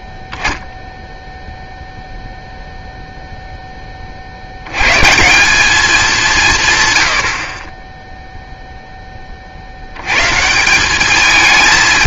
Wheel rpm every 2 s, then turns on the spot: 0, 0, 90, 170, 0, 160.
none